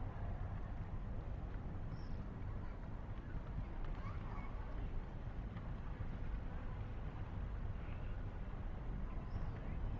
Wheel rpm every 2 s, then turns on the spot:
0, 0, 0, 0, 0.
none